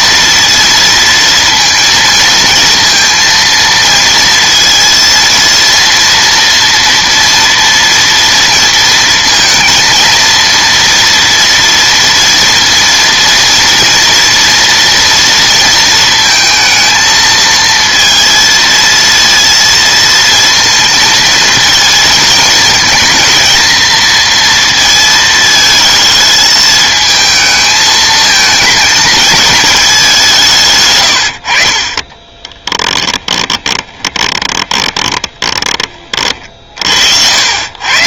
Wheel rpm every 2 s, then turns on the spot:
230, 230, 230, 230, 230, 230, 230, 230, 220, 230, 230, 220, 230, 220, 220, 140, 10, 20, 40.
32-36